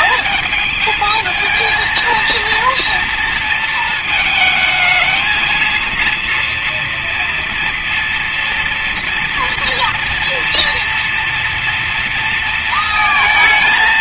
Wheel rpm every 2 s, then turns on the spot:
220, 230, 220, 230, 240, 230, 230.
none